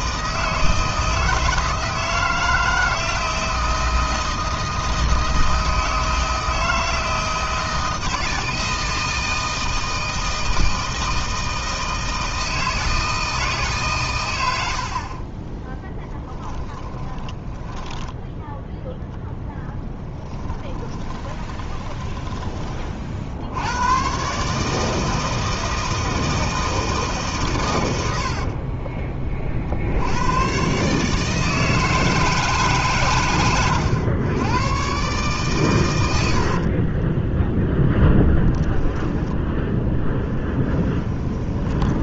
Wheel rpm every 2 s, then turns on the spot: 160, 160, 160, 160, 160, 160, 160, 60, 20, 0, 20, 30, 160, 160, 30, 140, 140, 120, 30, 0, 10.
16-18 20-22 28-30 36-38 40-42